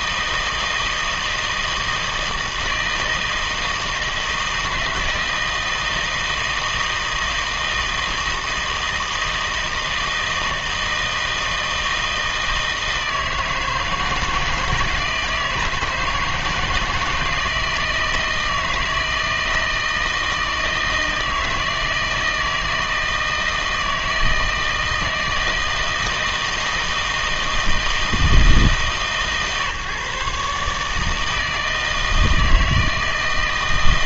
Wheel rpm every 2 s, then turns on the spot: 160, 160, 160, 160, 160, 160, 160, 160, 160, 160, 160, 160, 160, 160, 150, 150, 160.
none